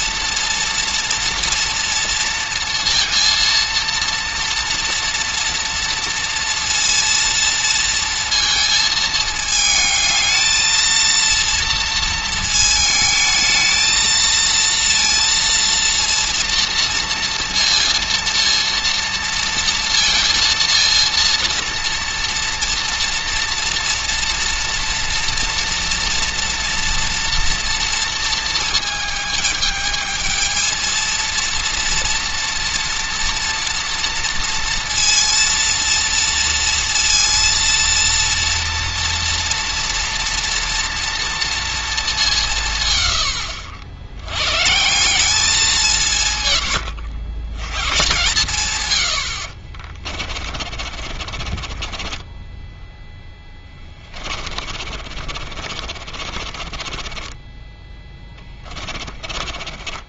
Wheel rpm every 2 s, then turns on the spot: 230, 230, 230, 230, 220, 220, 220, 230, 230, 230, 230, 230, 230, 230, 220, 230, 230, 230, 230, 230, 230, 160, 150, 110, 120, 40, 10, 40, 30, 20.
50-60